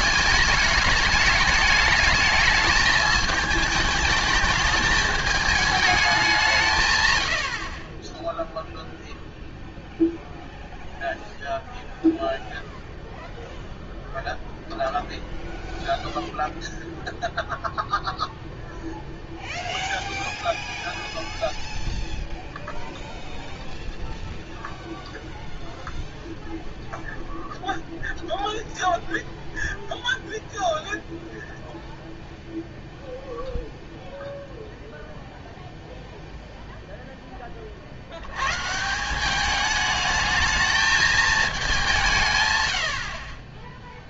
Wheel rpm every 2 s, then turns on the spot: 220, 220, 220, 170, 0, 0, 0, 0, 0, 0, 0, 0, 0, 0, 0, 0, 0, 0, 0, 120, 220, 100.
none